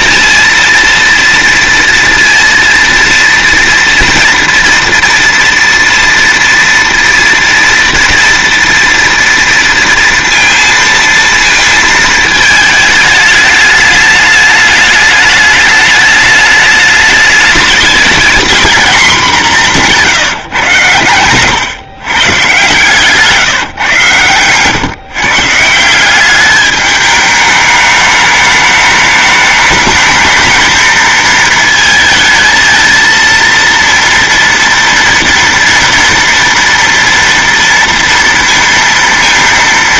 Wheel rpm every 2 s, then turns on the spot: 230, 230, 230, 230, 240, 230, 220, 210, 210, 230, 140, 140, 130, 210, 210, 220, 220, 230, 230, 230.
none